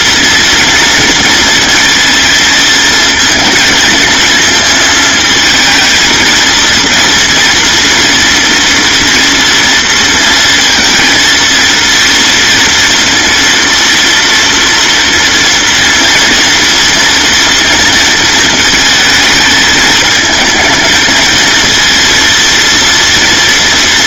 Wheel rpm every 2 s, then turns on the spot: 240, 230, 230, 230, 240, 230, 230, 230, 230, 220, 220, 230.
none